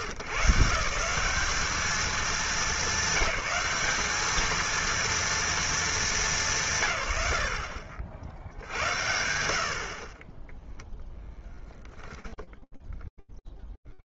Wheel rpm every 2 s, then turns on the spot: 150, 210, 210, 200, 50, 0, 0.
none